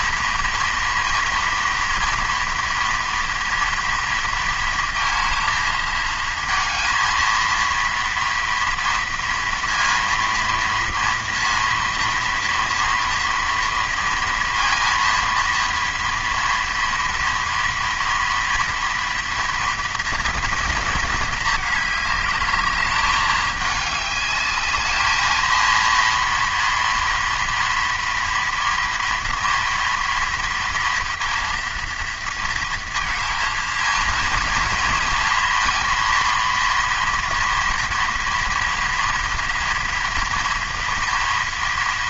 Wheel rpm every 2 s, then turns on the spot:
230, 230, 230, 220, 230, 240, 230, 230, 230, 230, 230, 210, 210, 240, 240, 230, 230, 230, 240, 230, 230.
none